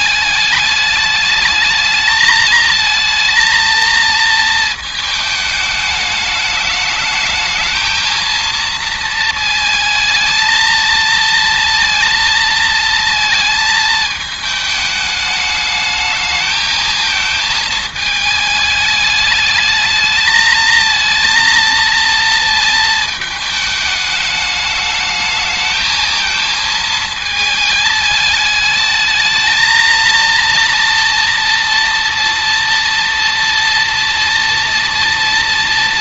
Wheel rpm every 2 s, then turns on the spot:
210, 220, 220, 220, 220, 230, 220, 210, 220, 210, 230, 220, 220, 220, 220, 230, 230, 230.
none